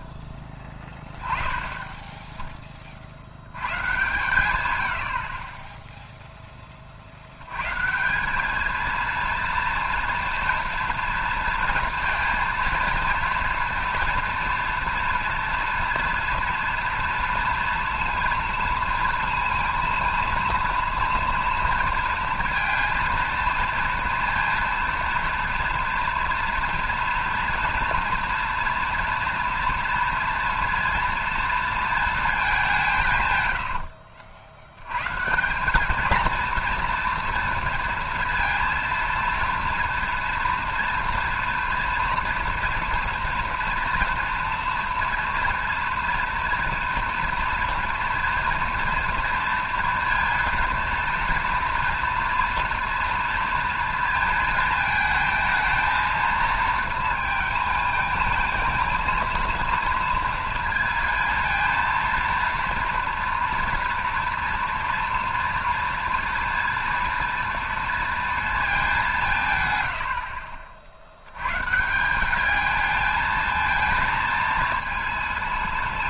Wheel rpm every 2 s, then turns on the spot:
30, 60, 70, 50, 230, 230, 230, 230, 230, 230, 230, 230, 230, 230, 230, 230, 150, 130, 230, 230, 230, 230, 230, 230, 230, 230, 230, 220, 220, 230, 230, 230, 230, 230, 180, 70, 220, 230.
none